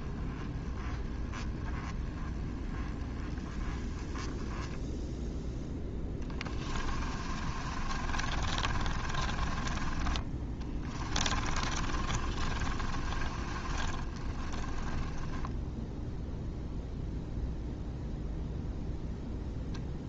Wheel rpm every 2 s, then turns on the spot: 10, 20, 10, 40, 40, 20, 40, 20, 0, 0.
6-16